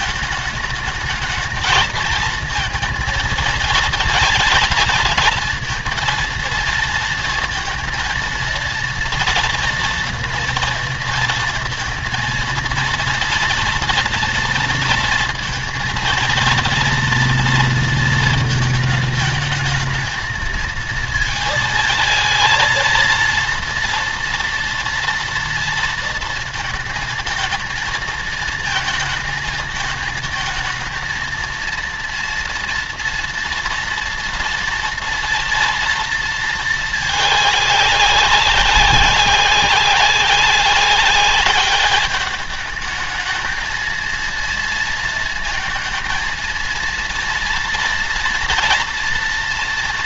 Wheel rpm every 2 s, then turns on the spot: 220, 220, 220, 230, 230, 230, 230, 230, 230, 220, 220, 230, 230, 230, 220, 220, 230, 230, 220, 190, 200, 220, 230, 230, 230.
none